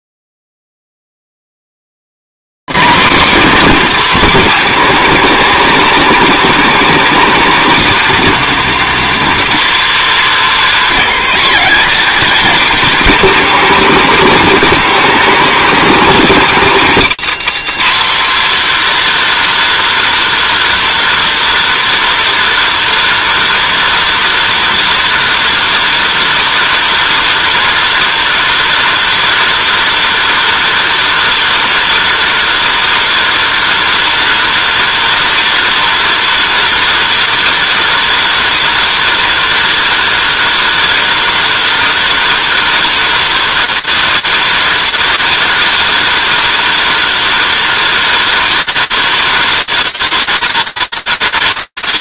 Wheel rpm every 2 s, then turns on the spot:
260, 260, 280, 280, 270, 270, 240, 290, 280, 280, 320, 330, 330, 330, 330, 330, 330, 330, 320, 330, 330, 330, 330, 330, 330, 330.
none